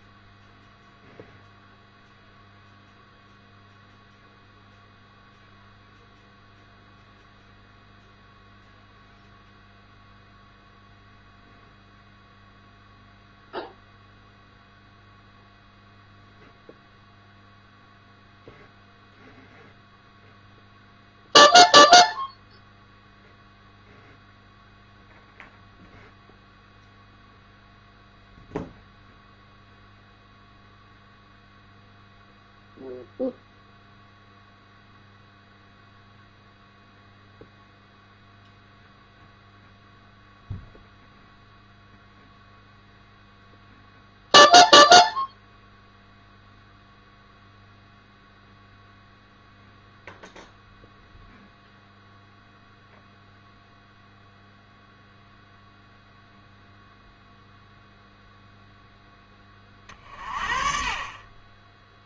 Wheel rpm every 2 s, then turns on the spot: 0, 0, 0, 0, 0, 0, 0, 0, 0, 0, 0, 0, 0, 0, 0, 0, 0, 0, 0, 0, 0, 0, 0, 0, 0, 0, 0, 0, 0, 0, 40.
none